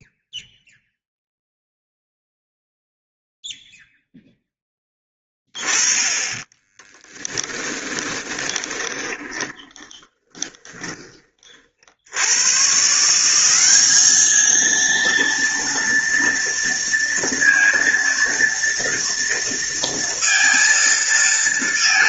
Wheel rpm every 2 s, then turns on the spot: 0, 0, 10, 20, 20, 20, 140, 230, 230, 230, 230.
6-10